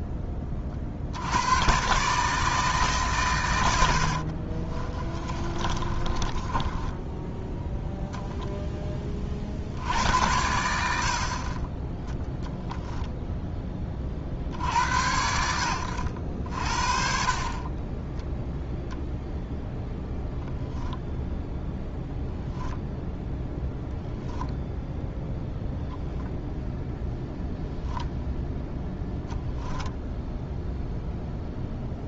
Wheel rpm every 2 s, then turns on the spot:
50, 150, 30, 10, 10, 70, 0, 80, 50, 0, 0, 0, 0, 0, 0, 0.
4-8